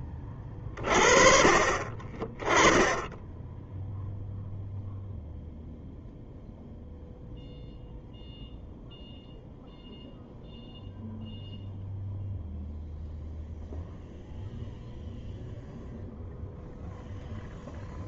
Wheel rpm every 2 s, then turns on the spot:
40, 10, 0, 0, 0, 0, 0, 0, 0.
none